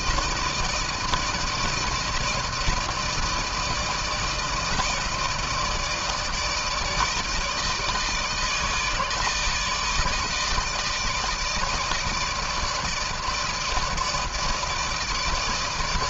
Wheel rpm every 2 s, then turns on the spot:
160, 160, 160, 160, 160, 150, 160, 160.
none